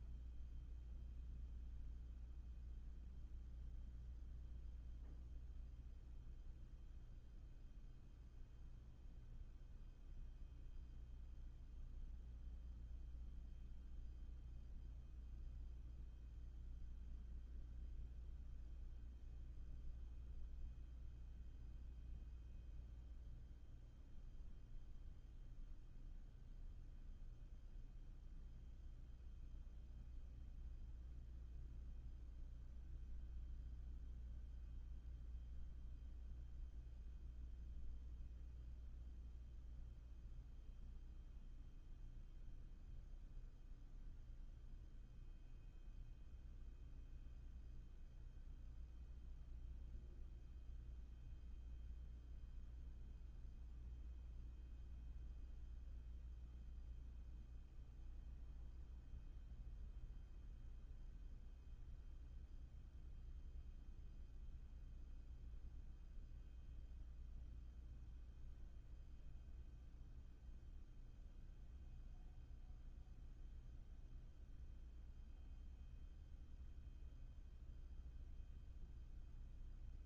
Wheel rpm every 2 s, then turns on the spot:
0, 0, 0, 0, 0, 0, 0, 0, 0, 0, 0, 0, 0, 0, 0, 0, 0, 0, 0, 0, 0, 0, 0, 0, 0, 0, 0, 0, 0, 0, 0, 0, 0, 0, 0, 0, 0, 0, 0, 0.
none